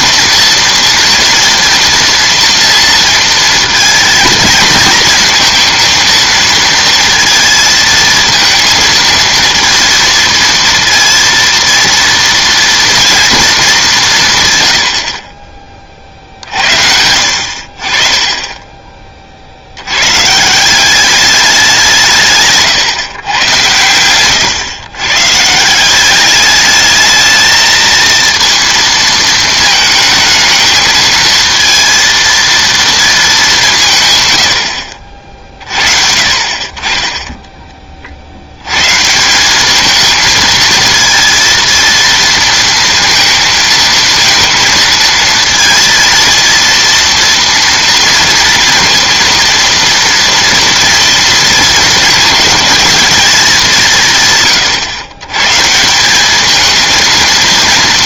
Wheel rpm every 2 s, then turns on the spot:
230, 230, 230, 230, 230, 230, 230, 100, 70, 30, 190, 130, 120, 210, 230, 220, 230, 70, 30, 100, 220, 220, 230, 230, 230, 230, 230, 130, 220.
none